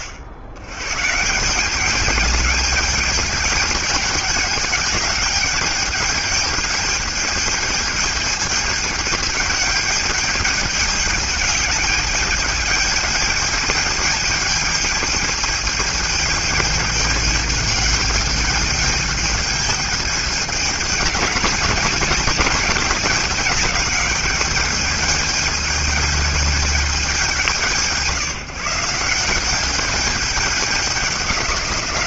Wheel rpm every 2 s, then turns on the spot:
100, 210, 210, 210, 220, 210, 210, 210, 210, 210, 210, 210, 210, 210, 160, 200.
none